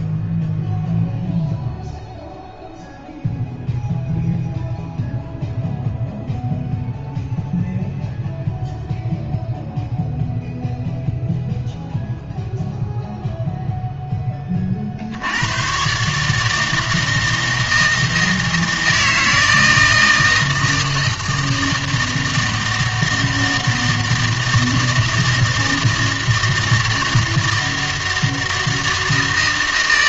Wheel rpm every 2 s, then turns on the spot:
0, 0, 0, 0, 0, 0, 0, 40, 160, 160, 160, 160, 160, 160, 160.
none